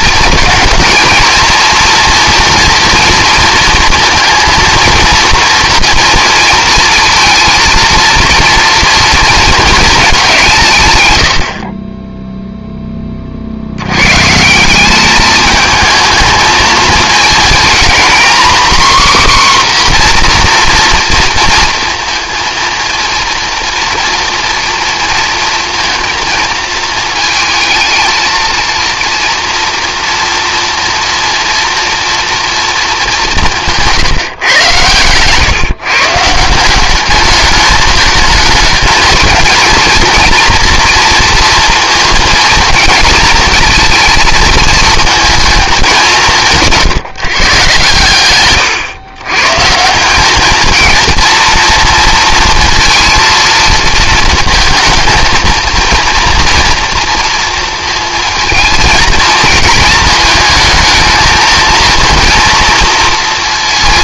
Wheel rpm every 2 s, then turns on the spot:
220, 230, 230, 230, 230, 150, 10, 180, 220, 260, 240, 230, 230, 220, 230, 230, 230, 120, 180, 220, 230, 230, 230, 170, 120, 220, 230, 220, 240, 220, 220, 230.
none